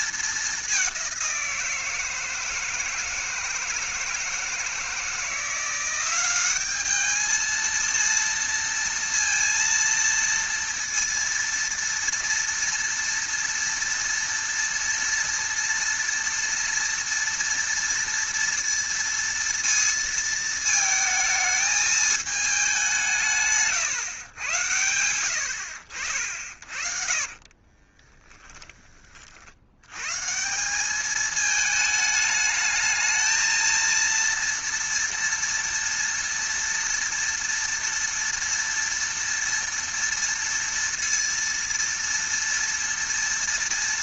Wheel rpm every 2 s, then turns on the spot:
200, 160, 160, 200, 230, 230, 230, 230, 230, 230, 220, 200, 100, 60, 20, 190, 220, 230, 230, 230, 230, 230.
26-28